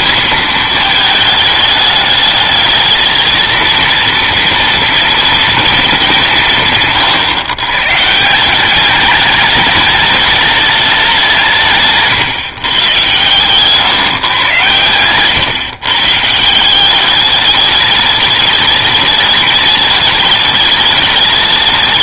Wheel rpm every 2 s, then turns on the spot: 230, 220, 230, 160, 180, 210, 140, 110, 170, 210, 210.
none